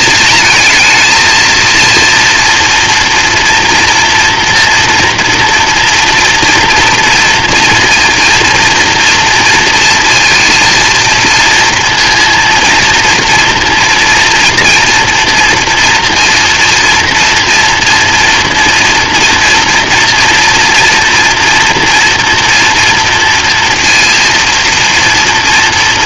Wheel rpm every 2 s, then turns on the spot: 220, 230, 230, 230, 230, 230, 230, 240, 230, 240, 230, 240, 230.
none